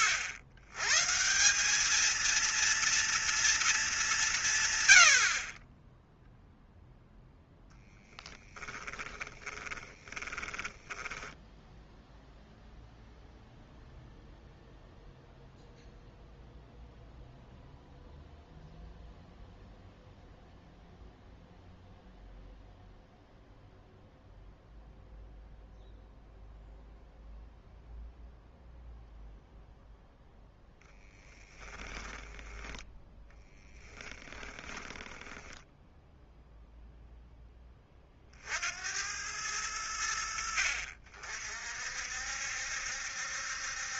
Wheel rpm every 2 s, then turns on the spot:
130, 230, 120, 0, 30, 10, 0, 0, 0, 0, 0, 0, 0, 0, 0, 10, 10, 20, 0, 70, 70, 70.
8-12 30-36